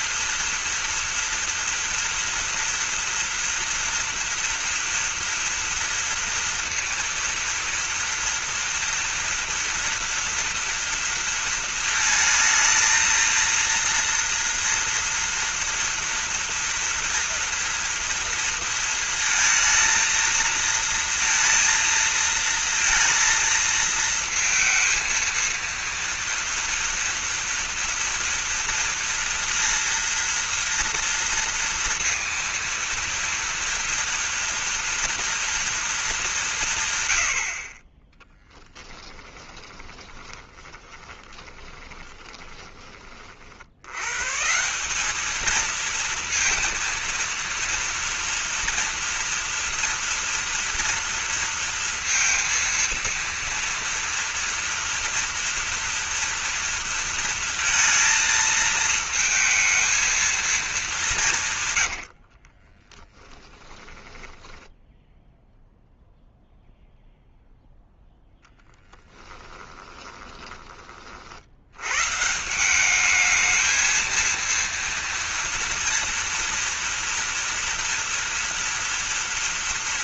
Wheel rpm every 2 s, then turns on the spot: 240, 240, 230, 230, 230, 230, 220, 230, 230, 230, 230, 230, 230, 230, 230, 230, 230, 230, 120, 20, 30, 40, 190, 230, 230, 230, 230, 240, 230, 220, 190, 20, 10, 0, 10, 40, 200, 230, 230, 230.
38-42 62-64 68-70